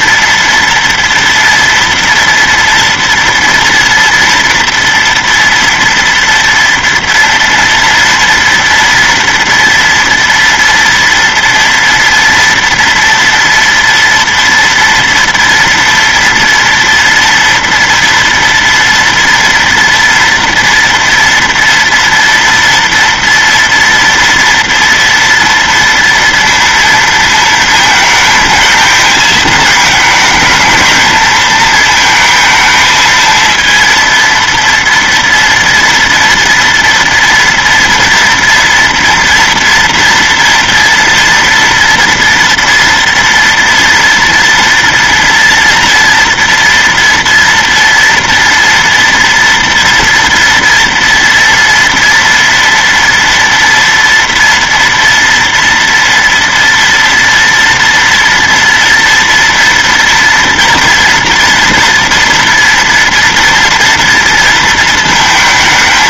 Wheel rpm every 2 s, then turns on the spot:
230, 230, 230, 230, 230, 230, 230, 230, 230, 230, 230, 230, 230, 230, 220, 220, 230, 230, 240, 230, 240, 230, 230, 230, 230, 230, 230, 230, 230, 230, 230, 230, 230.
none